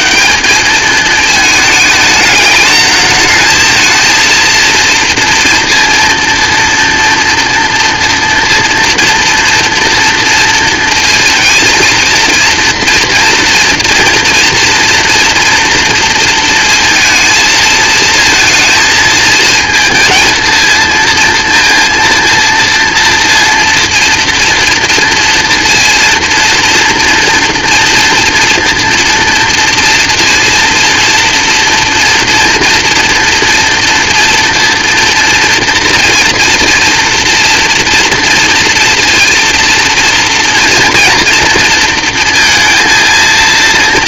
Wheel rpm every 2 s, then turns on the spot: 200, 220, 230, 230, 230, 230, 230, 230, 230, 220, 230, 230, 240, 230, 240, 230, 230, 230, 230, 230, 230, 230.
none